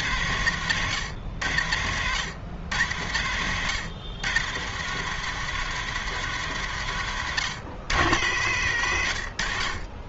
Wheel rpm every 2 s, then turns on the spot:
130, 110, 160, 140, 120.
none